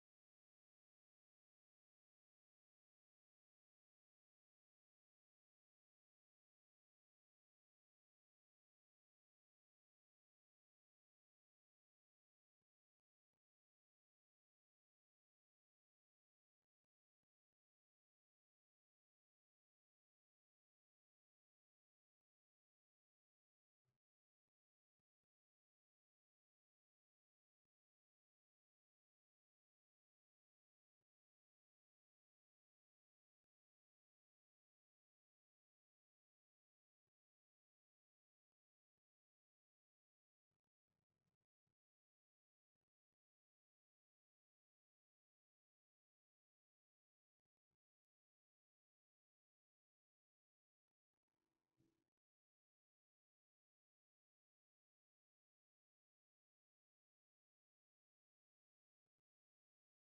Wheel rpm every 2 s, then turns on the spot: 0, 0, 0, 0, 0, 0, 0, 0, 0, 0, 0, 0, 0, 0, 0, 0, 0, 0, 0, 0, 0, 0, 0, 0, 0, 0, 0, 0, 0, 0.
none